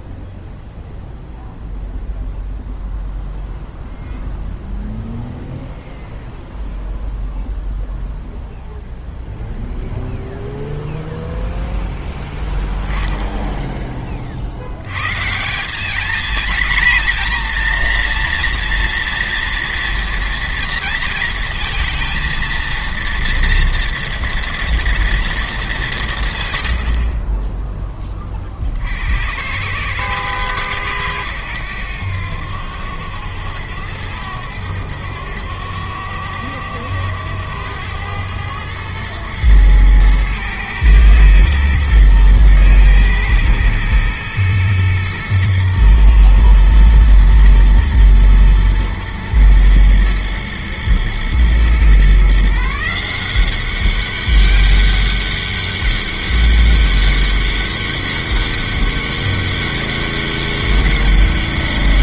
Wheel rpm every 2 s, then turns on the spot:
0, 0, 0, 0, 0, 0, 0, 110, 240, 230, 230, 230, 230, 80, 70, 110, 90, 90, 90, 110, 110, 110, 110, 110, 120, 120, 160, 200, 200, 200, 200.
none